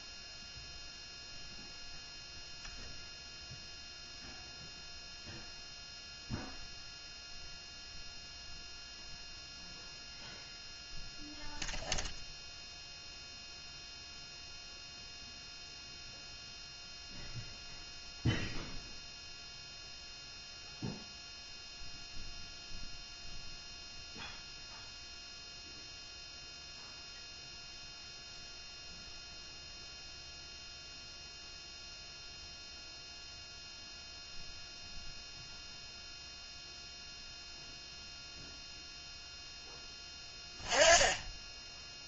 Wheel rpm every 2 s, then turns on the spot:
0, 0, 0, 0, 0, 0, 0, 0, 0, 0, 0, 0, 0, 0, 0, 0, 0, 0, 0, 0, 10.
none